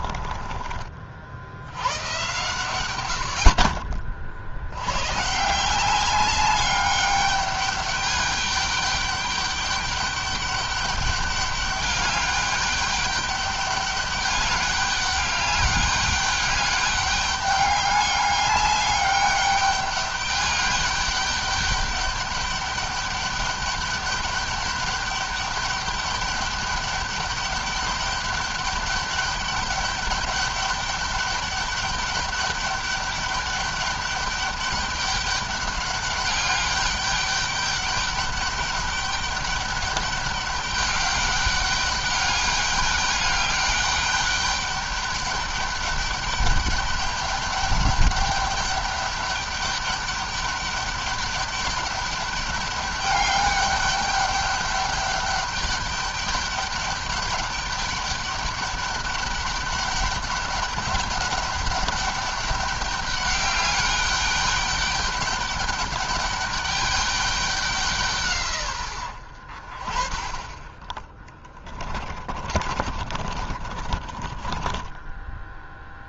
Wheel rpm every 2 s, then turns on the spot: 30, 130, 80, 200, 210, 200, 200, 200, 200, 200, 210, 210, 210, 200, 200, 200, 200, 200, 200, 200, 200, 200, 200, 200, 200, 200, 200, 200, 200, 200, 200, 200, 200, 200, 130, 20, 40, 20.
72-76